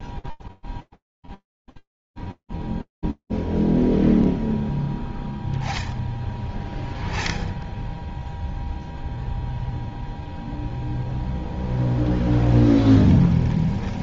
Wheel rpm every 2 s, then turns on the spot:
0, 0, 0, 10, 0, 0, 10.
12-14